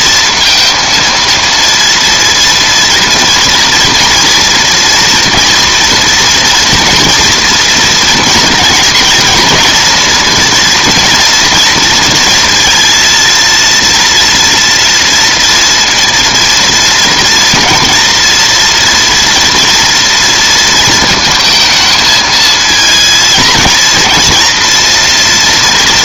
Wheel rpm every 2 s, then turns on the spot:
230, 230, 230, 230, 230, 240, 230, 230, 230, 230, 230, 220, 230.
none